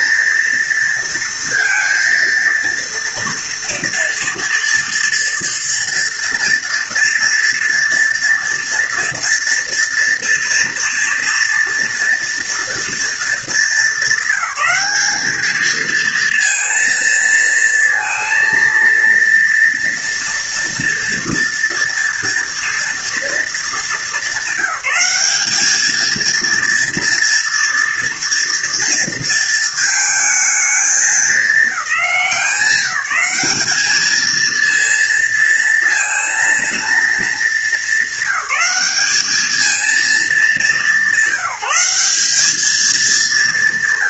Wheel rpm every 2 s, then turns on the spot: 230, 230, 230, 230, 230, 230, 230, 210, 230, 230, 230, 230, 200, 230, 230, 220, 200, 230, 220, 200, 190, 200.
none